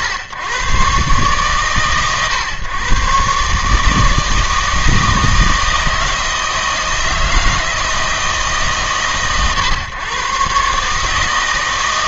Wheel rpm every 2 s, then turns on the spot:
110, 120, 160, 160, 120, 140.
none